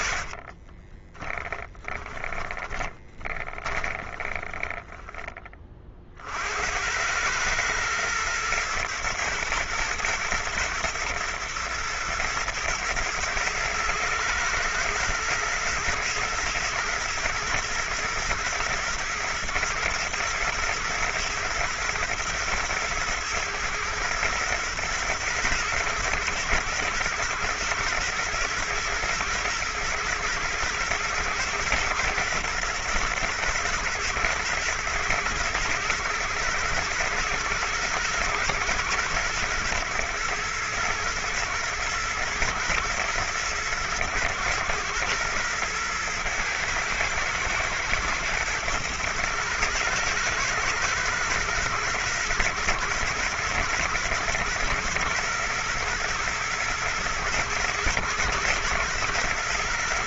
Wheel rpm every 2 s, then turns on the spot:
40, 20, 20, 50, 120, 110, 120, 110, 110, 120, 120, 110, 110, 110, 120, 120, 120, 120, 110, 110, 110, 110, 110, 110, 110, 110, 120, 120, 110, 110.
0-6